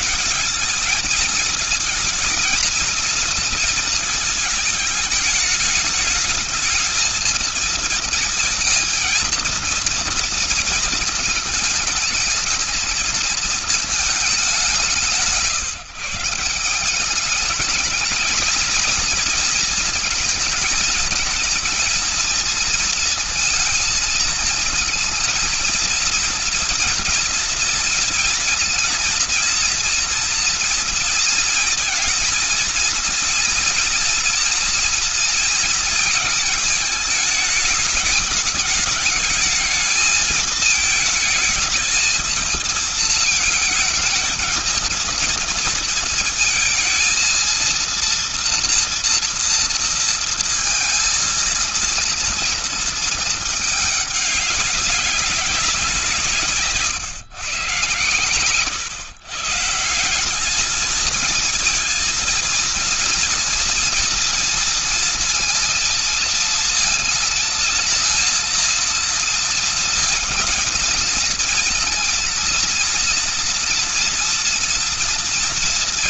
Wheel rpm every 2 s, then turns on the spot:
220, 230, 210, 220, 230, 220, 220, 160, 200, 220, 220, 230, 220, 230, 230, 230, 230, 240, 220, 210, 220, 220, 230, 230, 230, 230, 220, 200, 130, 120, 220, 230, 230, 230, 230, 230, 230, 230.
none